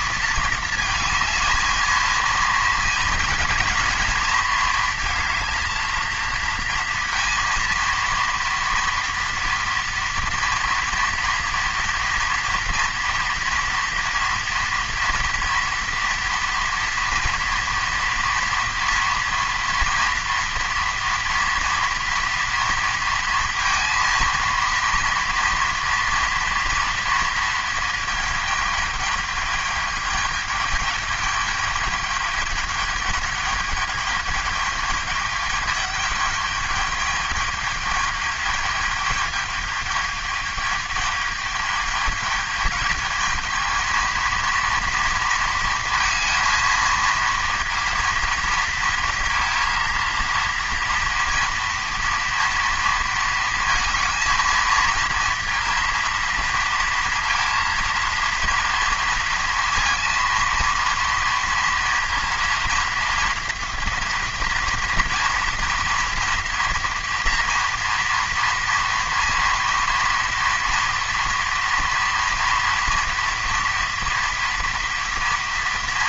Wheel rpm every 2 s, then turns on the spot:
230, 230, 230, 230, 230, 230, 230, 230, 230, 230, 230, 230, 230, 230, 220, 210, 210, 210, 210, 210, 210, 210, 230, 230, 230, 230, 230, 220, 230, 230, 230, 230, 240, 240, 230, 230, 230, 230.
none